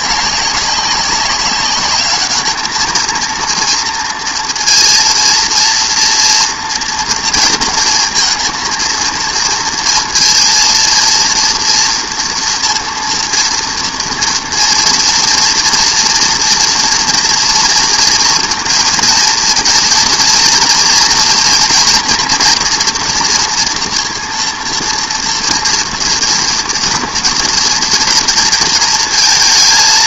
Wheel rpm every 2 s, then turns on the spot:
190, 210, 230, 230, 230, 230, 230, 230, 230, 230, 230, 240, 230, 230, 230.
none